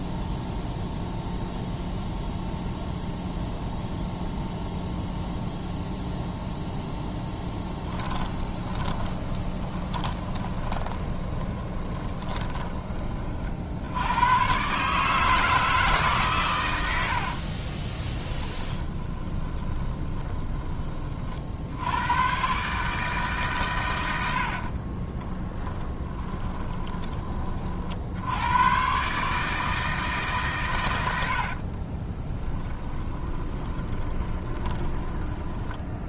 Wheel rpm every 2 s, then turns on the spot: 0, 0, 0, 0, 20, 20, 30, 140, 90, 20, 20, 140, 40, 20, 120, 100, 20, 20.
8-12 18-20 24-28 32-36